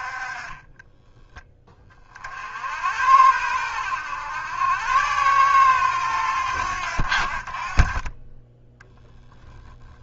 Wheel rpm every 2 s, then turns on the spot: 20, 80, 100, 70, 10.
0-2 8-10